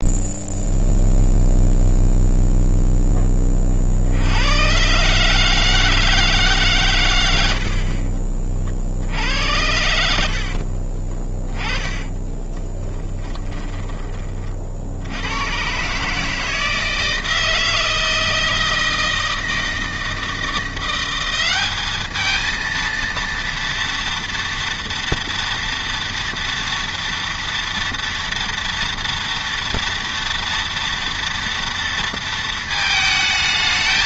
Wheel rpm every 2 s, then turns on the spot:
0, 0, 100, 140, 50, 50, 20, 50, 160, 160, 170, 220, 230, 230, 230, 240, 230.
10-14